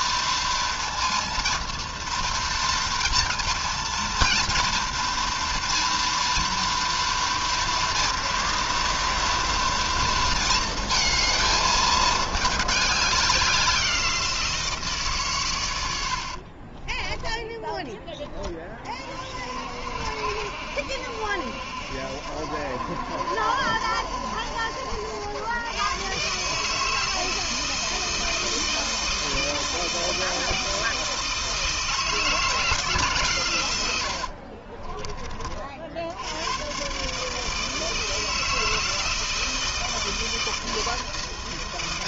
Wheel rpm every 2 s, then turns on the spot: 230, 230, 230, 230, 230, 230, 210, 170, 40, 20, 60, 70, 70, 150, 160, 160, 160, 50, 100, 160, 160.
16-18 34-36